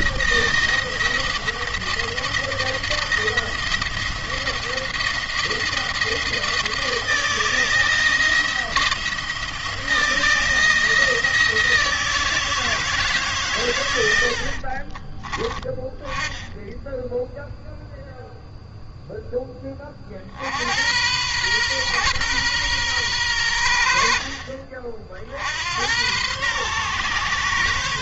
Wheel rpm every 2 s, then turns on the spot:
160, 170, 160, 160, 170, 160, 160, 40, 10, 0, 90, 120, 50, 120.
14-16